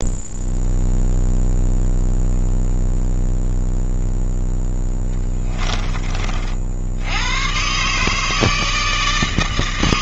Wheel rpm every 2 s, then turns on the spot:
0, 0, 10, 70, 160.
4-6